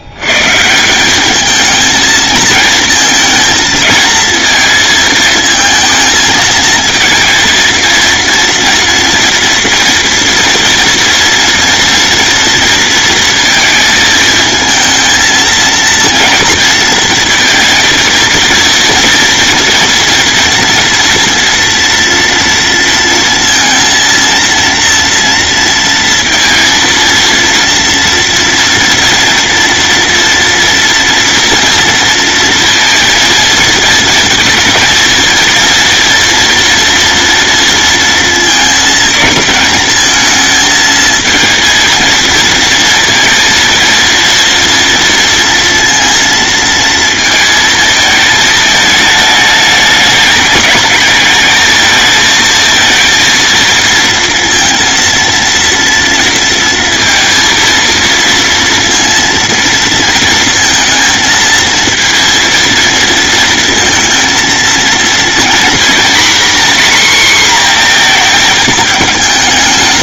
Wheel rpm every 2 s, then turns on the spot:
150, 220, 230, 220, 230, 230, 230, 220, 230, 230, 230, 230, 230, 230, 230, 230, 230, 230, 230, 230, 220, 230, 230, 230, 220, 210, 220, 230, 230, 230, 230, 230, 230, 250, 220.
none